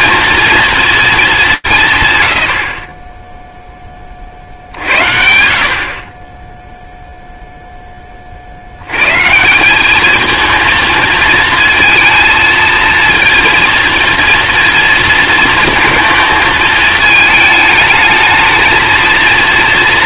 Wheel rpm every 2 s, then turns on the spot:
230, 150, 50, 20, 70, 220, 230, 230, 220, 220.
none